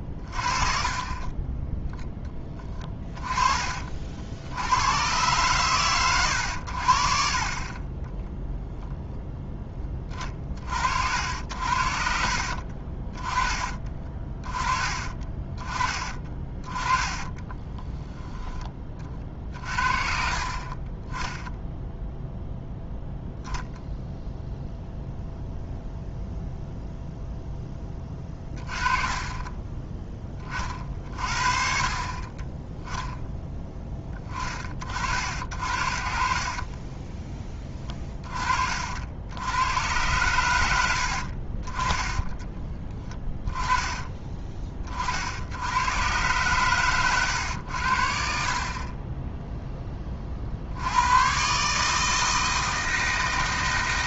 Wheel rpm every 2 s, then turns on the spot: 30, 20, 70, 60, 0, 50, 50, 30, 20, 20, 30, 0, 0, 0, 20, 40, 20, 30, 10, 40, 70, 20, 30, 120, 40, 80, 160.
12-14 28-30 36-38 42-44